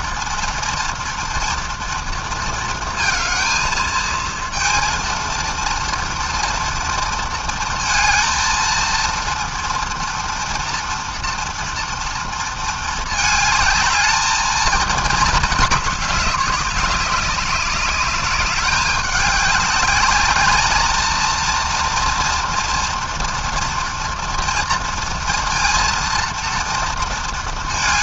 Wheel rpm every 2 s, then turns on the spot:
230, 230, 230, 230, 230, 230, 220, 220, 200, 200, 230, 230, 240, 230.
none